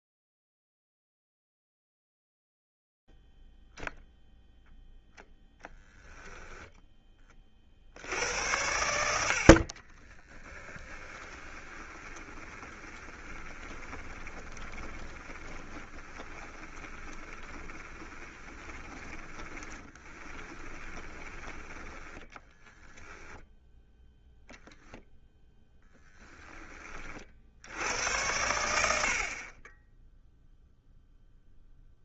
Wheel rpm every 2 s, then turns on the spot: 0, 0, 0, 0, 80, 20, 20, 20, 20, 20, 20, 20, 10, 20, 90, 0.
10-24